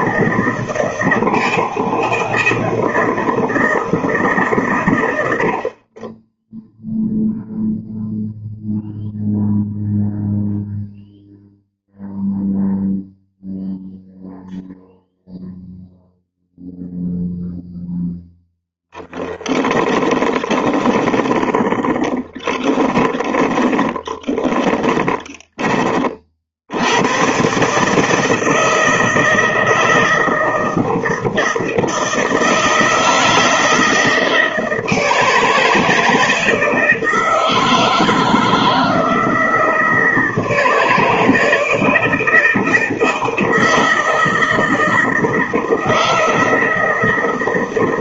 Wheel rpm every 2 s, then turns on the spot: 160, 160, 120, 0, 0, 0, 0, 0, 0, 0, 20, 20, 30, 60, 160, 170, 160, 160, 160, 160, 160, 160, 160, 160.
20-26